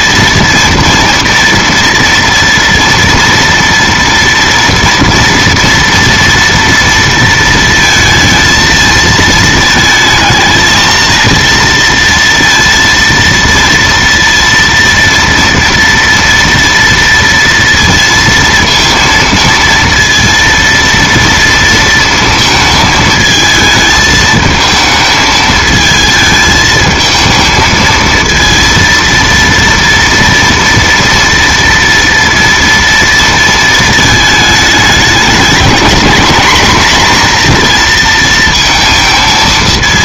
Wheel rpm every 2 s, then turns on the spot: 230, 230, 230, 230, 220, 220, 230, 230, 230, 220, 230, 220, 220, 220, 230, 230, 230, 220, 240, 220.
none